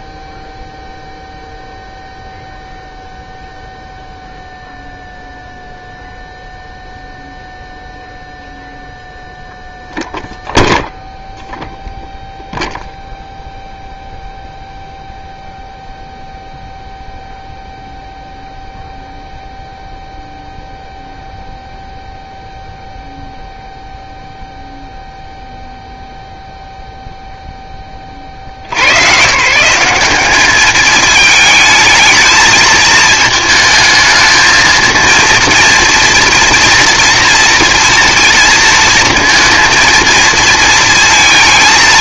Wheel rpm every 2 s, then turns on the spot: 0, 0, 0, 0, 0, 0, 0, 0, 0, 0, 0, 0, 0, 0, 110, 210, 220, 220, 240, 230, 220.
none